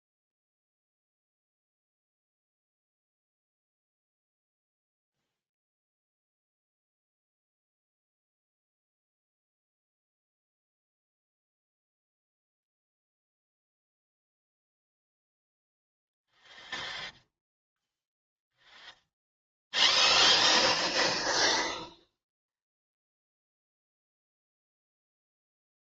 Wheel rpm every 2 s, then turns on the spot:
0, 0, 0, 0, 0, 0, 0, 0, 0, 0, 0, 0, 0.
none